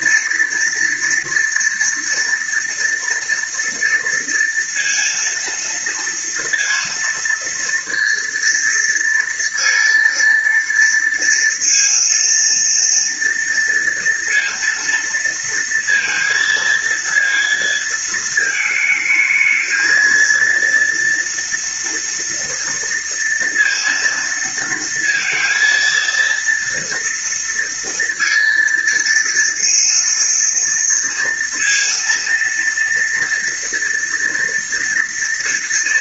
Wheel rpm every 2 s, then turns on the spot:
230, 230, 230, 230, 230, 230, 230, 230, 230, 220, 230, 230, 230, 230, 230, 230, 230, 230.
none